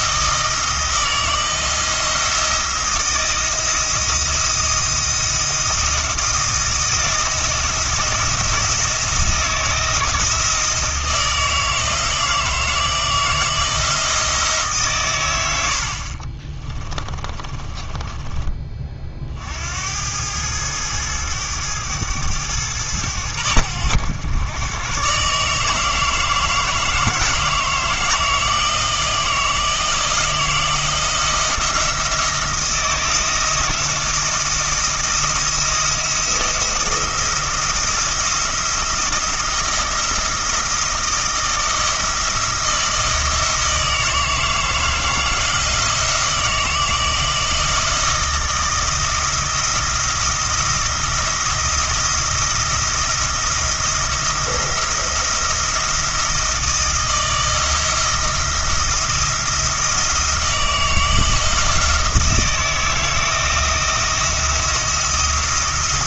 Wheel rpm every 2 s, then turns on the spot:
160, 170, 170, 160, 170, 160, 160, 140, 40, 20, 110, 100, 110, 160, 160, 170, 170, 170, 170, 170, 170, 160, 160, 170, 170, 170, 170, 170, 170, 170, 160, 160, 170.
16-18